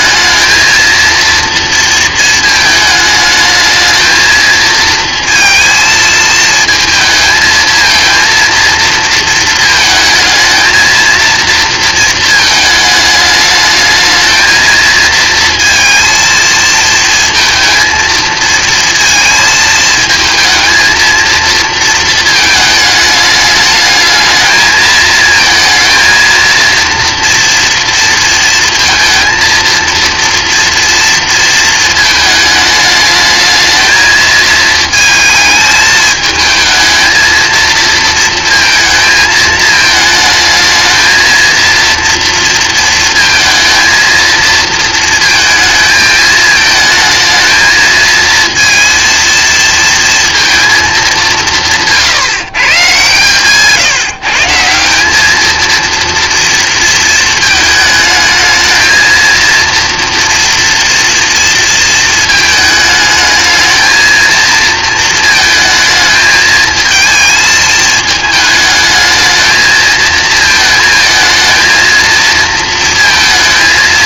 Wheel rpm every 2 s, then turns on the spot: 220, 220, 230, 220, 230, 230, 220, 230, 220, 230, 230, 210, 220, 230, 230, 230, 220, 220, 220, 230, 220, 230, 230, 220, 230, 220, 150, 190, 230, 220, 230, 220, 230, 220, 220, 220, 230.
none